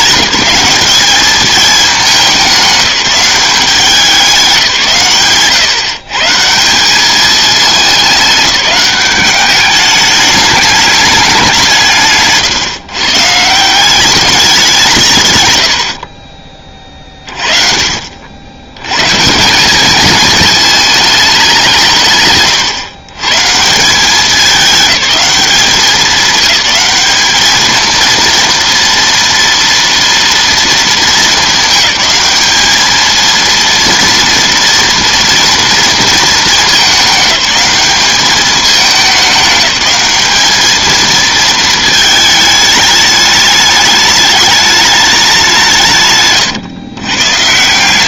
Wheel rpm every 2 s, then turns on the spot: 200, 190, 170, 180, 200, 210, 150, 190, 30, 100, 220, 130, 200, 200, 230, 220, 210, 230, 210, 210, 220, 220, 210, 140.
none